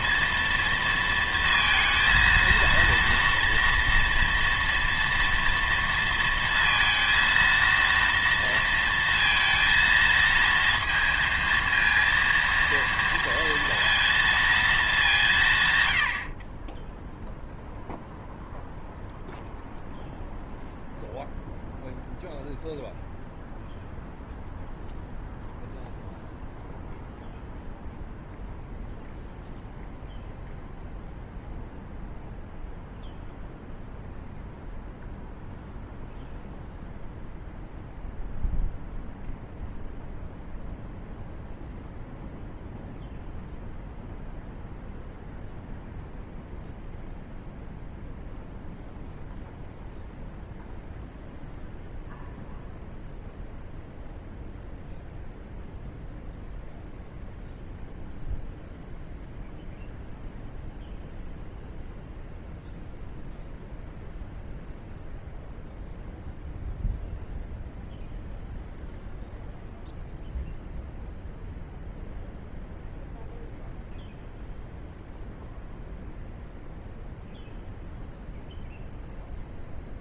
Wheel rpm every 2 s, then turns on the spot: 230, 230, 230, 230, 230, 230, 230, 220, 20, 0, 0, 0, 0, 0, 0, 0, 0, 0, 0, 0, 0, 0, 0, 0, 0, 0, 0, 0, 0, 0, 0, 0, 0, 0, 0, 0, 0, 0, 0, 0.
none